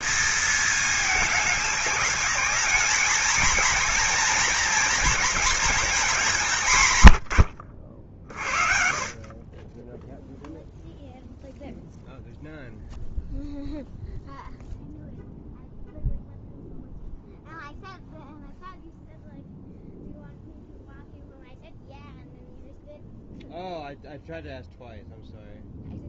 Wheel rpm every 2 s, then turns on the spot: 220, 220, 230, 130, 40, 0, 0, 0, 0, 0, 0, 0, 0.
none